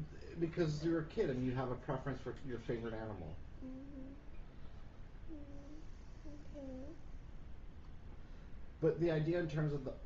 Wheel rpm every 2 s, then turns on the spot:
0, 0, 0, 0, 0.
none